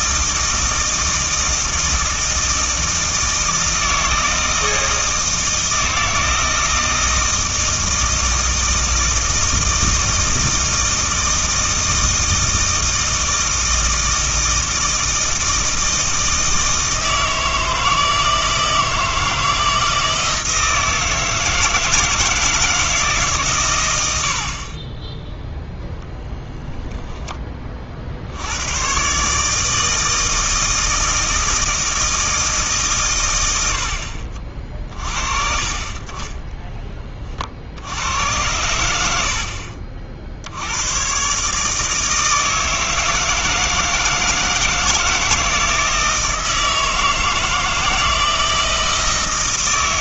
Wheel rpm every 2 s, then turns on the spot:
160, 160, 160, 160, 160, 160, 160, 160, 160, 160, 160, 160, 30, 10, 110, 160, 140, 40, 10, 80, 90, 160, 160, 160, 160.
none